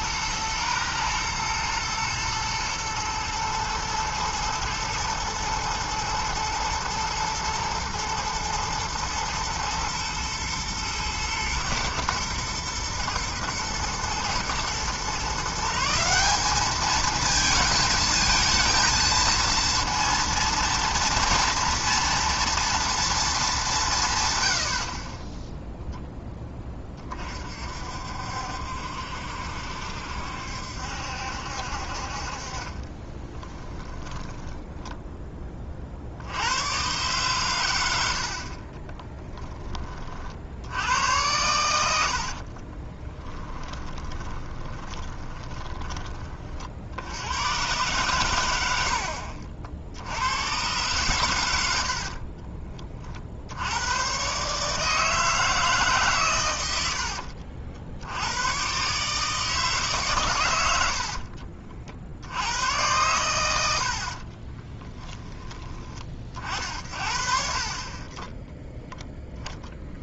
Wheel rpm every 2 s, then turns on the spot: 120, 110, 110, 110, 120, 110, 120, 130, 210, 220, 230, 230, 40, 30, 70, 70, 30, 10, 120, 30, 90, 30, 20, 70, 70, 120, 40, 160, 70, 140, 70, 90, 20, 50, 0.
32-34 38-40 42-46 56-58 60-62 64-66